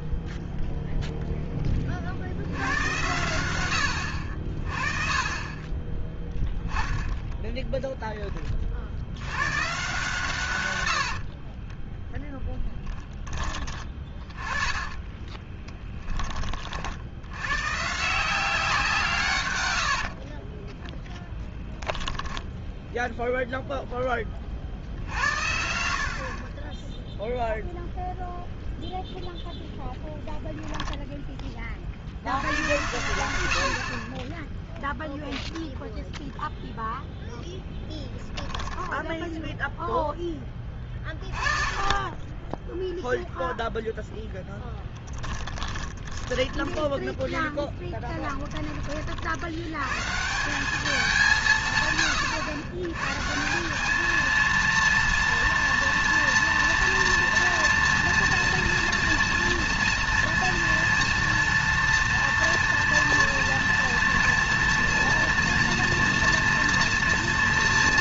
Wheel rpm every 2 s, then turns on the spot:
0, 90, 40, 10, 30, 110, 10, 20, 50, 180, 20, 10, 50, 20, 0, 10, 90, 0, 0, 10, 20, 0, 10, 10, 20, 190, 110, 220, 230, 230, 230, 230, 230, 230.
4-8 12-16 20-22 38-40